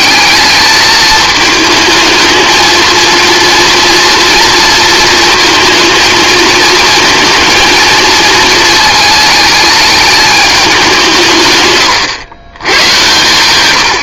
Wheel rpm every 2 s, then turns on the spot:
210, 220, 230, 220, 220, 200, 110.
none